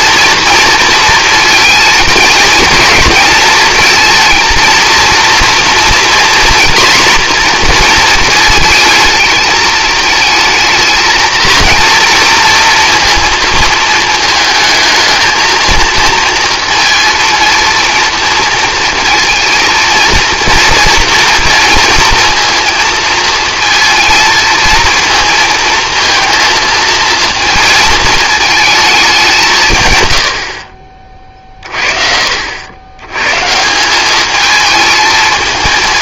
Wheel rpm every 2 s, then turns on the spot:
230, 230, 230, 240, 220, 220, 230, 220, 230, 230, 230, 230, 230, 230, 220, 50, 90, 220.
none